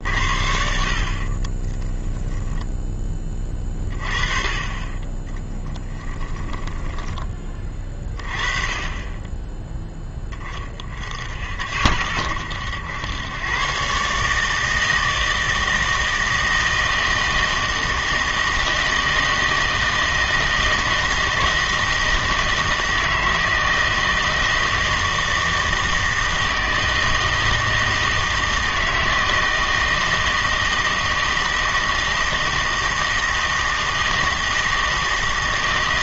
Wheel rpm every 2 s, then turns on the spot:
60, 0, 30, 10, 30, 30, 90, 160, 160, 160, 160, 160, 160, 160, 160, 160, 160, 160.
6-8